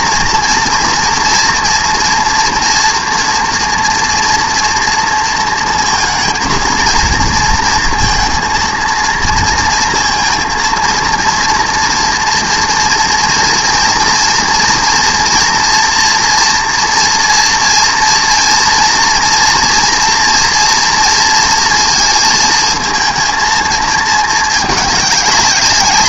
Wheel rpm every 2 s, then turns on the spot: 230, 230, 230, 230, 230, 230, 230, 230, 240, 230, 230, 220, 210.
none